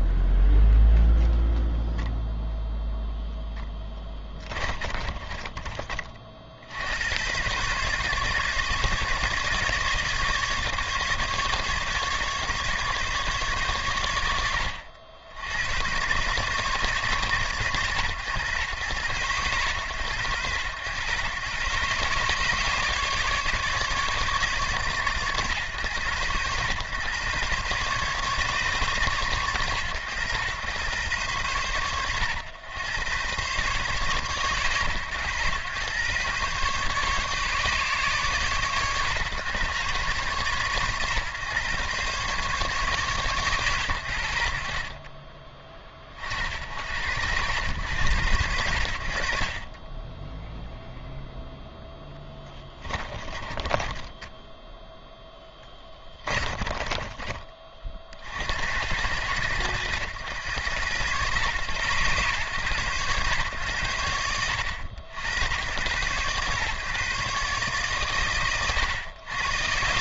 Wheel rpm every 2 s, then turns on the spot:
0, 0, 20, 70, 140, 150, 140, 70, 140, 120, 110, 150, 140, 120, 140, 110, 100, 120, 140, 120, 120, 140, 70, 70, 80, 0, 20, 10, 30, 80, 100, 120, 70, 130, 100.
4-6 52-54 56-58